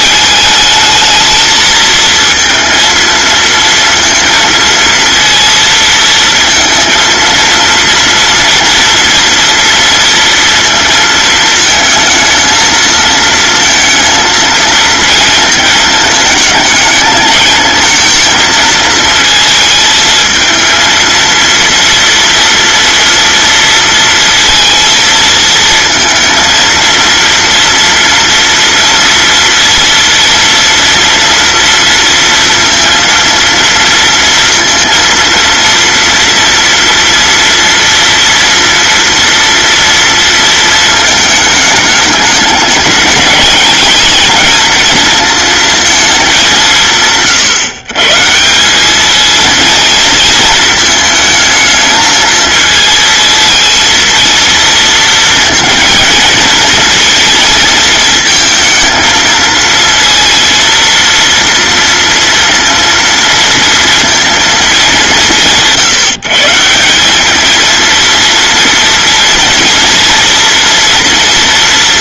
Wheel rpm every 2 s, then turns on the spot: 220, 230, 230, 230, 230, 230, 220, 220, 220, 220, 230, 230, 230, 230, 230, 230, 230, 230, 230, 240, 220, 210, 230, 160, 200, 220, 220, 230, 230, 230, 230, 230, 190, 170, 230, 230.
none